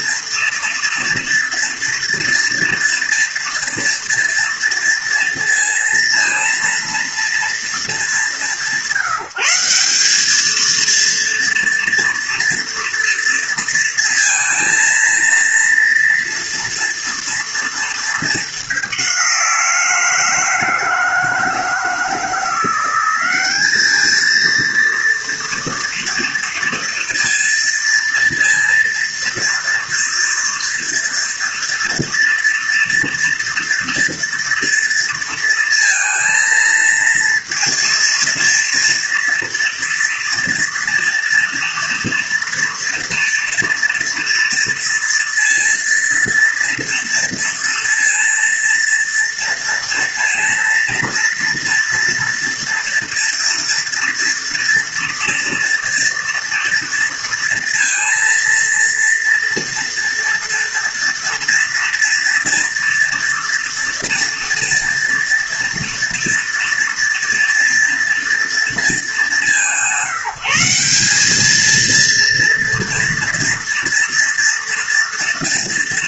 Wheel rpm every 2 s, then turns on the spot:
230, 230, 230, 230, 170, 220, 230, 230, 230, 200, 160, 180, 230, 230, 230, 230, 230, 230, 230, 230, 230, 230, 230, 230, 230, 230, 230, 230, 230, 230, 230, 230, 230, 230, 220, 190, 240, 230.
none